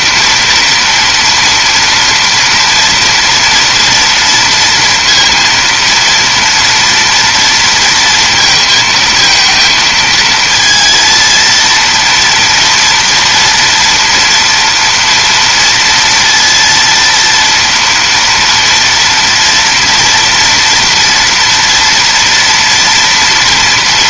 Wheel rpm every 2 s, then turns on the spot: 240, 230, 230, 230, 230, 230, 230, 240, 230, 230, 230, 230.
none